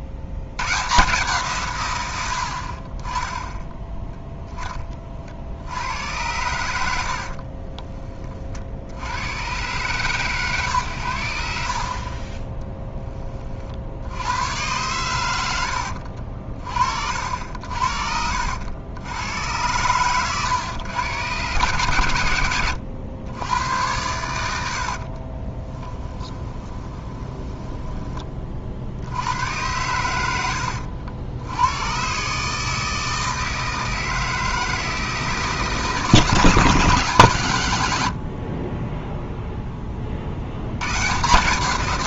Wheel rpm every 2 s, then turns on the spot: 110, 60, 20, 90, 50, 130, 20, 110, 50, 80, 130, 100, 90, 20, 50, 80, 150, 160, 170, 50, 100.
2-4 24-28